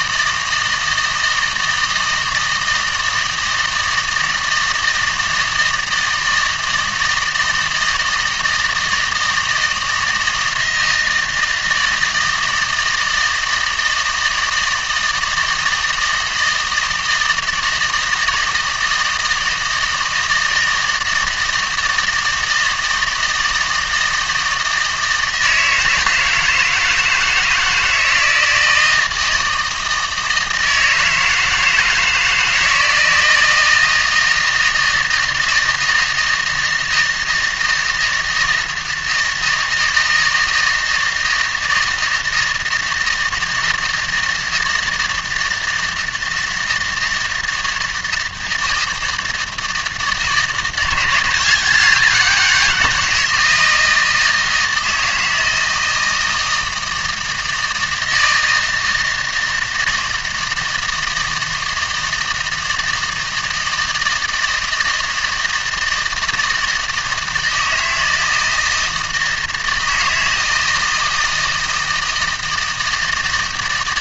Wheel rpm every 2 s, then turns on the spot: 160, 160, 160, 160, 160, 160, 160, 160, 160, 160, 160, 160, 160, 160, 160, 160, 160, 160, 160, 160, 160, 160, 160, 160, 160, 170, 180, 160, 160, 160, 160, 160, 160, 160, 160, 160, 160.
none